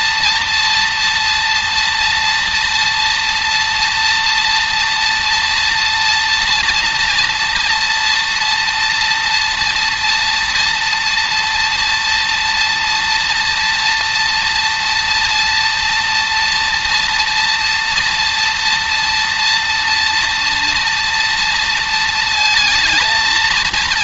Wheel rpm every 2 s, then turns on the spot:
230, 230, 230, 230, 230, 230, 230, 230, 230, 230, 240, 230.
none